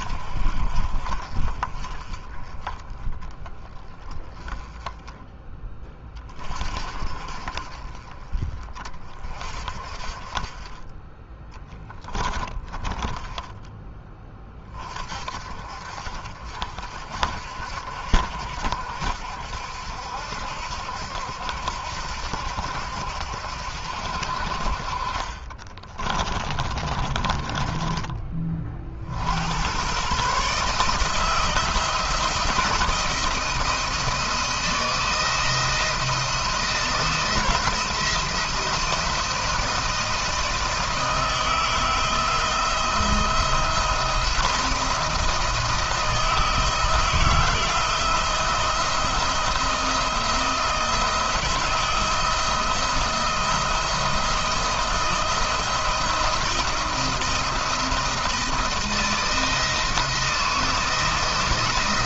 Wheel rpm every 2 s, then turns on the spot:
40, 20, 10, 30, 30, 20, 20, 30, 50, 60, 70, 70, 50, 30, 40, 150, 160, 160, 170, 170, 160, 160, 170, 160, 160, 170, 160, 170, 170, 160, 170.
12-14 26-28